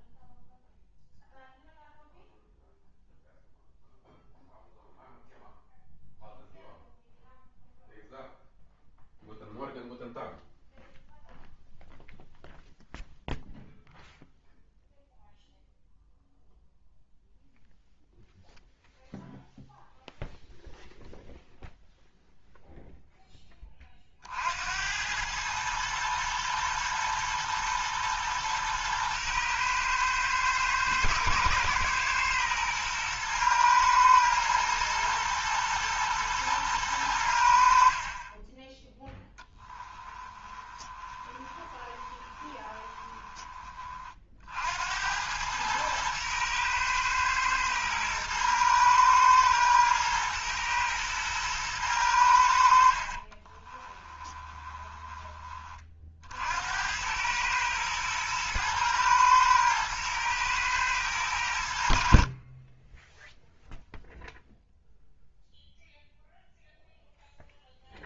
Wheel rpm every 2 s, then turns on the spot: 0, 0, 0, 0, 0, 0, 0, 0, 0, 0, 0, 0, 70, 110, 110, 110, 120, 120, 110, 10, 20, 20, 80, 110, 110, 110, 70, 20, 80, 110, 110, 30, 0, 0.
40-44 54-56